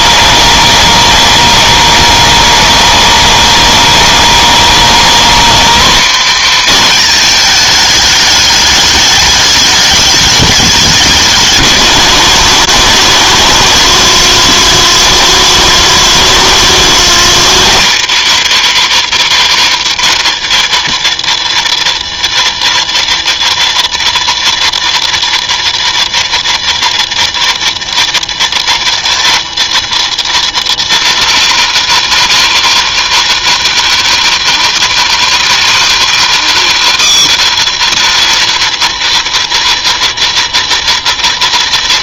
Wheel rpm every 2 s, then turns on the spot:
240, 240, 240, 260, 220, 210, 170, 120, 120, 130, 170, 170, 170, 170, 180, 180, 170, 170, 170, 170, 170.
none